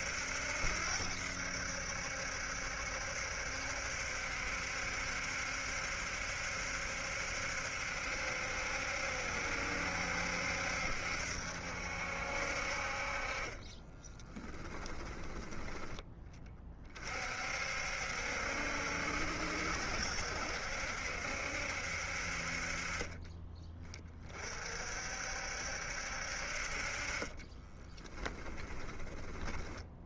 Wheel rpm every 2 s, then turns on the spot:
80, 70, 70, 70, 70, 70, 60, 10, 30, 70, 70, 40, 40, 50, 20.
14-16 28-30